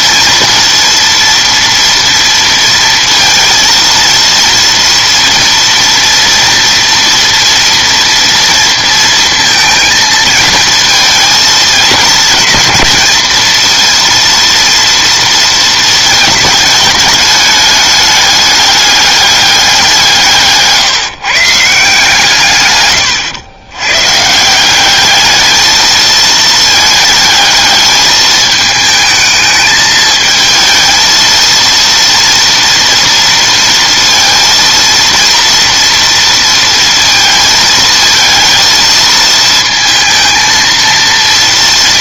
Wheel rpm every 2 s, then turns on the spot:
230, 230, 230, 230, 230, 220, 230, 230, 210, 210, 150, 130, 190, 220, 220, 220, 230, 230, 230, 220, 230.
none